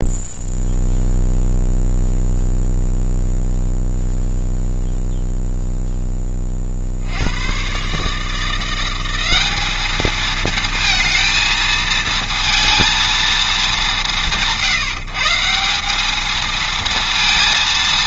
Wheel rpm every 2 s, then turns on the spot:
0, 0, 0, 40, 170, 220, 230, 140, 220.
none